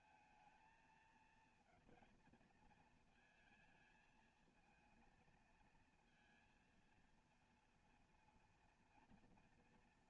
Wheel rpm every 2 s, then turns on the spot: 220, 220, 230, 230, 230.
none